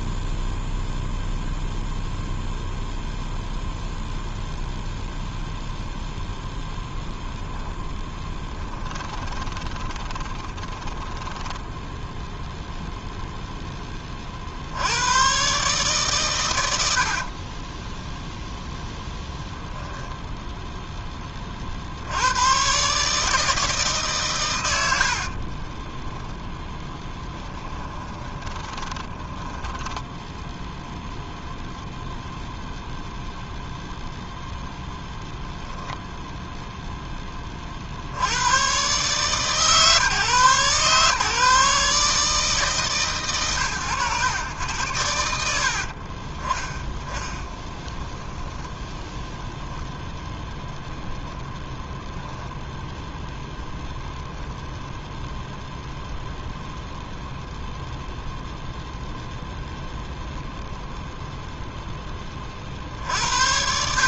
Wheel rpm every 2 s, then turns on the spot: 0, 0, 0, 0, 10, 20, 0, 70, 130, 0, 0, 130, 90, 10, 20, 10, 0, 0, 0, 120, 130, 150, 110, 10, 10, 10, 0, 0, 0, 0, 0, 40.
8-12 26-30 48-50